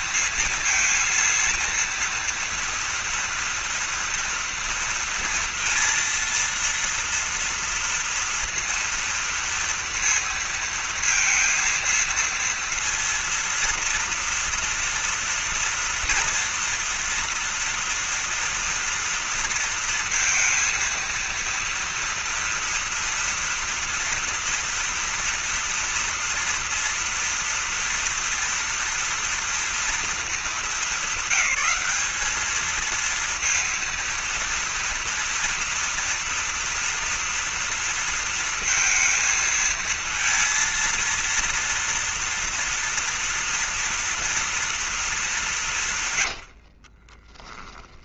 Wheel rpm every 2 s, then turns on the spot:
230, 230, 230, 230, 230, 230, 230, 230, 230, 230, 230, 230, 230, 230, 230, 200, 220, 230, 230, 230, 230, 230, 230, 80.
46-48